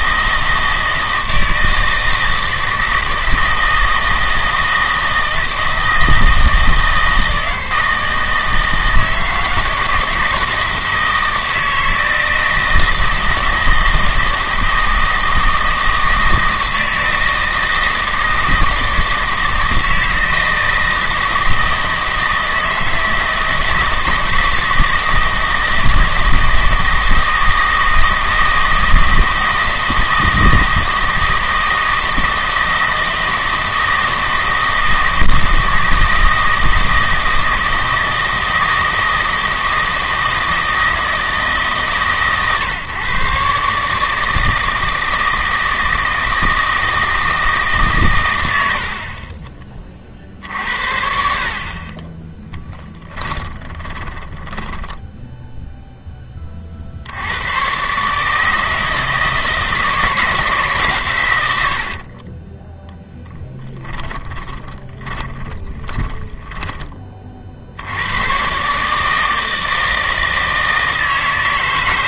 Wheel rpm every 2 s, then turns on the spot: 160, 160, 160, 160, 160, 160, 160, 160, 160, 160, 160, 160, 160, 160, 160, 160, 160, 160, 160, 160, 160, 120, 160, 160, 60, 50, 10, 10, 50, 160, 140, 10, 20, 20, 140, 160.
52-56 62-66